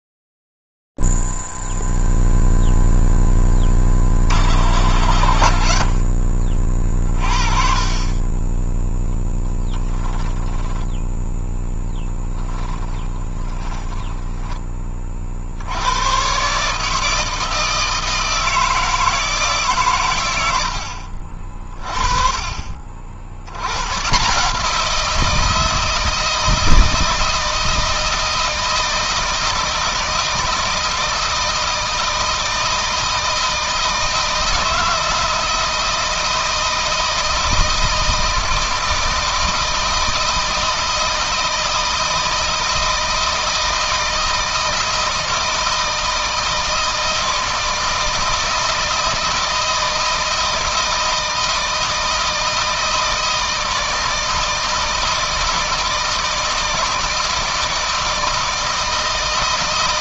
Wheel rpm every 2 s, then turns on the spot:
0, 0, 40, 50, 20, 10, 20, 20, 140, 160, 90, 50, 160, 160, 160, 160, 160, 160, 160, 160, 160, 160, 160, 160, 160, 160, 160, 160, 160, 160.
12-14